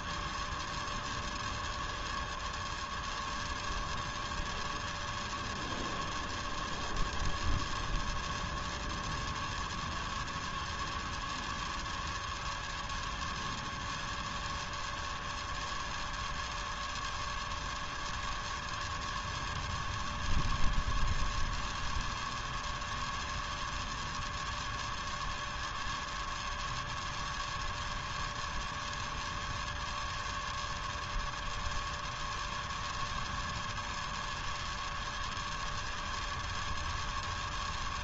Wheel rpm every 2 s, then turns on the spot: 0, 0, 0, 0, 0, 0, 0, 0, 0, 0, 0, 0, 0, 0, 0, 0, 0, 0, 0.
none